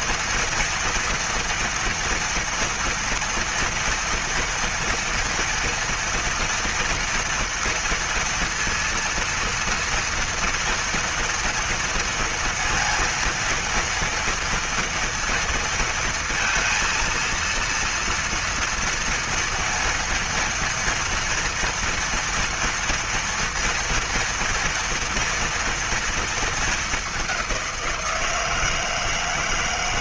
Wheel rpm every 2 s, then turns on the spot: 230, 230, 230, 230, 230, 230, 230, 230, 230, 230, 230, 230, 230, 210, 160.
none